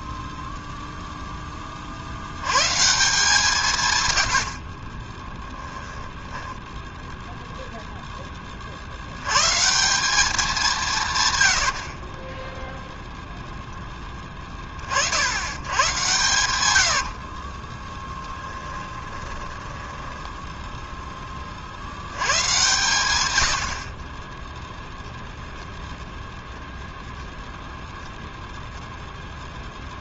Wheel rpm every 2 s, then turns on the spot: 0, 140, 20, 0, 60, 180, 0, 50, 70, 10, 0, 120, 0, 0, 0.
4-6 16-20